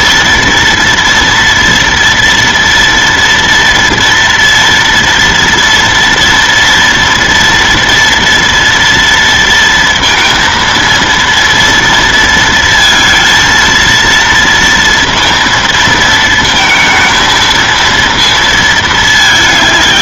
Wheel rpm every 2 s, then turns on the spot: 230, 230, 230, 230, 240, 230, 230, 230, 220, 220.
none